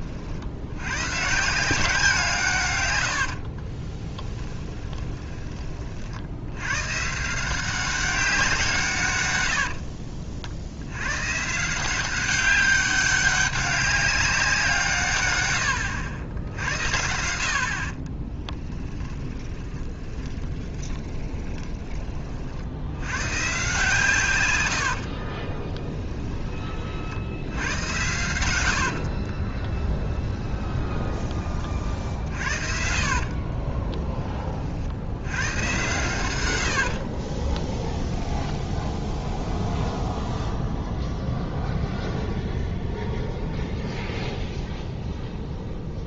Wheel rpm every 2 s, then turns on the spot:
90, 130, 20, 100, 170, 70, 190, 160, 70, 10, 10, 70, 100, 30, 80, 10, 40, 50, 80, 0, 0, 0, 0.
4-6 18-22 24-26 28-34 36-38